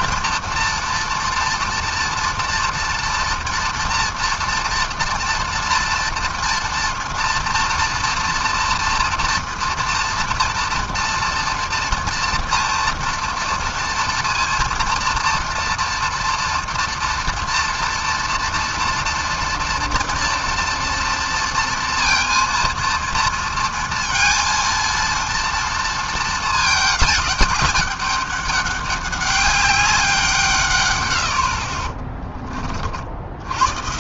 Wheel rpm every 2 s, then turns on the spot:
240, 240, 230, 230, 240, 230, 240, 230, 230, 230, 230, 230, 230, 220, 200, 140, 30.
none